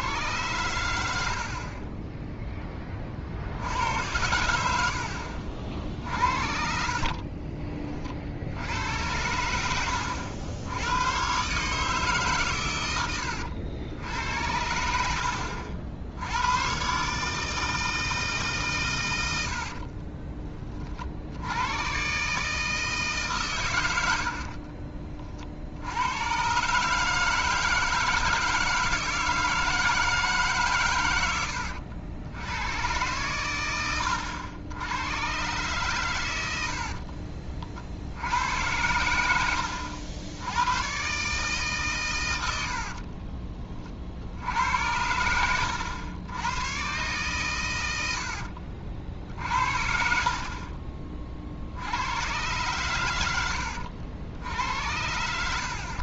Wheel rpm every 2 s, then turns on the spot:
100, 10, 80, 50, 80, 90, 110, 90, 100, 140, 30, 160, 50, 130, 160, 140, 100, 90, 70, 90, 100, 70, 80, 120, 50, 40, 120, 70.
4-8 24-26 42-44 48-52